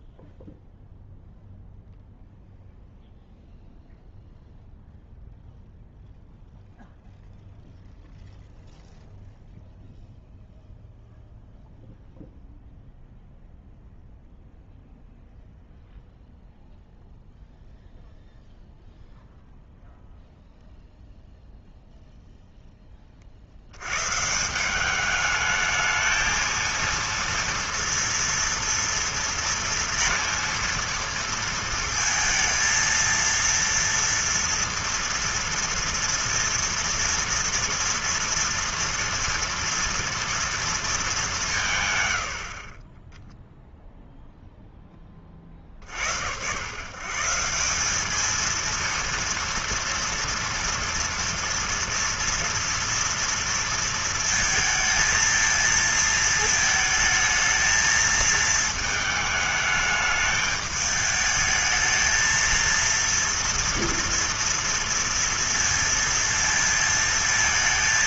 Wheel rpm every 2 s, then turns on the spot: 0, 0, 0, 0, 0, 0, 0, 0, 0, 0, 0, 0, 170, 230, 230, 230, 230, 230, 230, 240, 230, 60, 0, 90, 220, 230, 230, 230, 230, 220, 210, 230, 230, 230.
none